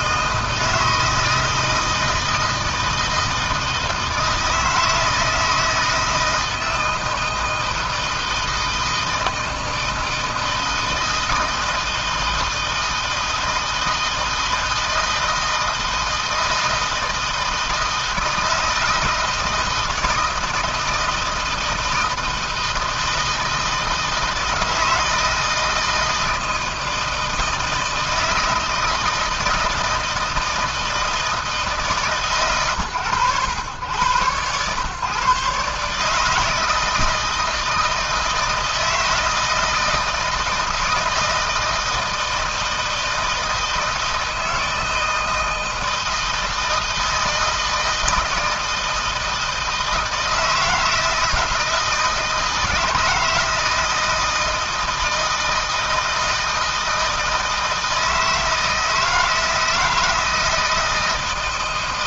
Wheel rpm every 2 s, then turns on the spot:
160, 160, 160, 160, 160, 160, 160, 160, 160, 160, 160, 160, 160, 160, 160, 160, 120, 120, 160, 160, 160, 160, 160, 160, 160, 160, 160, 160, 160, 160, 160.
none